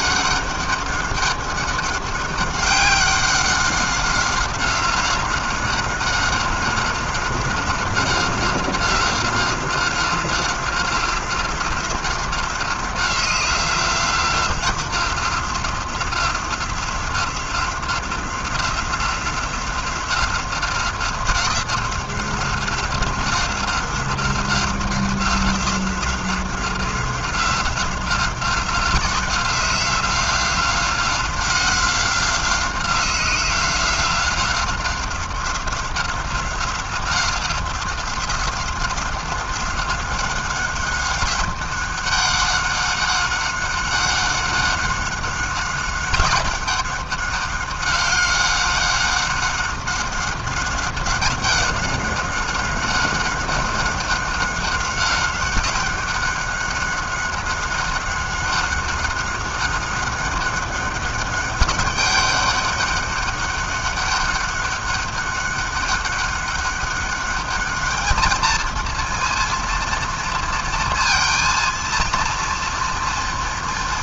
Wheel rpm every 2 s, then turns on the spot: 200, 190, 190, 190, 190, 180, 180, 180, 180, 180, 180, 180, 180, 180, 180, 180, 180, 180, 180, 180, 190, 200, 190, 190, 200, 200, 190, 190, 200, 190, 200, 200, 200, 200, 220, 230, 230.
none